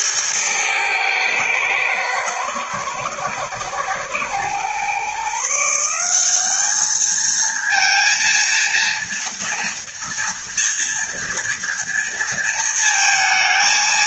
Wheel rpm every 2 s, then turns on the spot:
110, 120, 130, 210, 230, 230, 230.
none